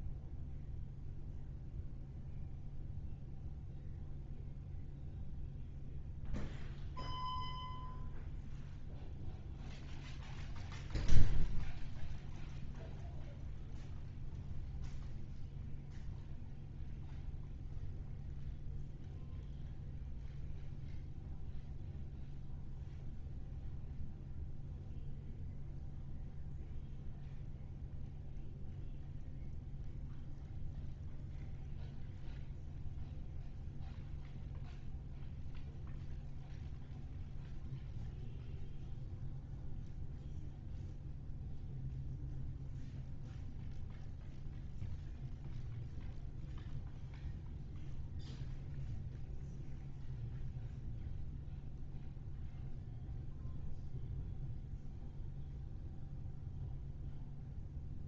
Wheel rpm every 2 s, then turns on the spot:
0, 0, 0, 0, 0, 0, 0, 0, 0, 0, 0, 0, 0, 0, 0, 0, 0, 0, 0, 0, 0, 0, 0, 0, 0, 0, 0, 0, 0.
none